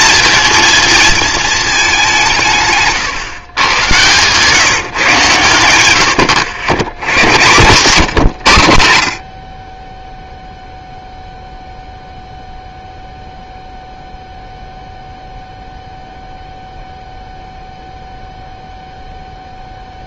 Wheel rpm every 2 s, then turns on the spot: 230, 140, 140, 100, 90, 0, 0, 0, 0, 0.
none